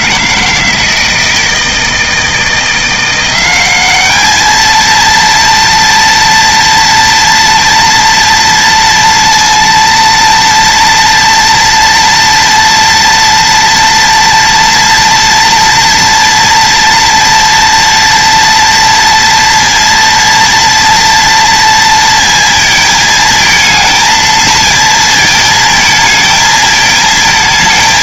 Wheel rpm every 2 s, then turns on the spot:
160, 170, 220, 240, 230, 230, 230, 230, 230, 230, 230, 230, 230, 220.
none